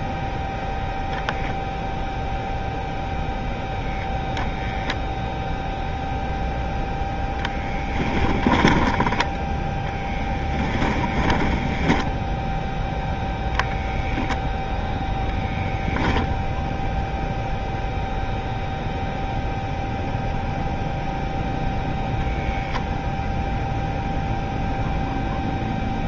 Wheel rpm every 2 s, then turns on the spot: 0, 0, 0, 0, 20, 20, 0, 0, 0, 0, 0, 0, 0.
10-12